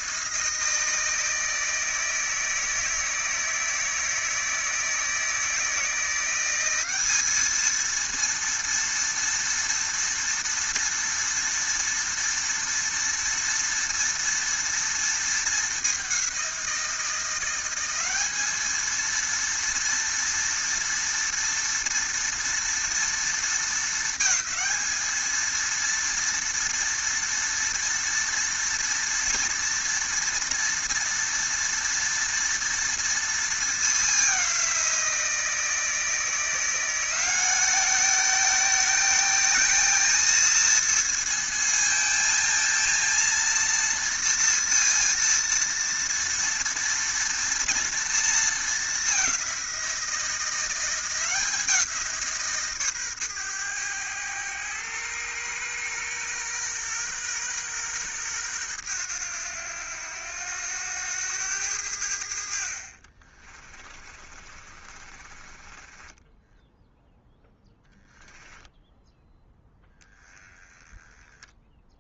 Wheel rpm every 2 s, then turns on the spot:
160, 160, 160, 200, 230, 230, 230, 230, 180, 220, 230, 230, 220, 230, 230, 240, 230, 180, 180, 220, 230, 230, 230, 230, 210, 180, 140, 110, 120, 100, 100, 40, 30, 0, 0, 10.
62-66